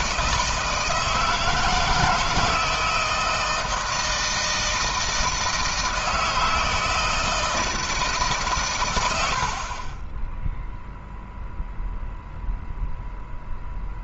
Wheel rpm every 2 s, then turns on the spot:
160, 160, 160, 160, 110, 0, 0.
none